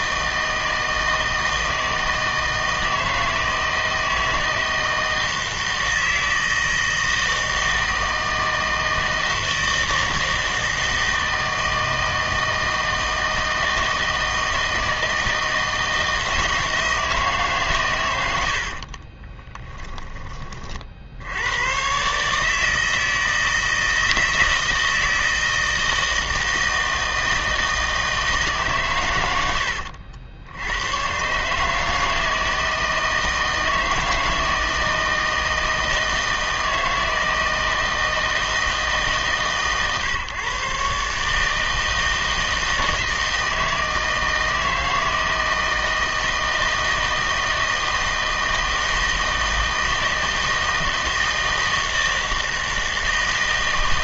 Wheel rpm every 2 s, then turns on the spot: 160, 160, 160, 160, 160, 160, 160, 160, 170, 60, 50, 160, 160, 160, 140, 100, 160, 160, 160, 160, 140, 160, 160, 160, 160, 160, 160.
18-20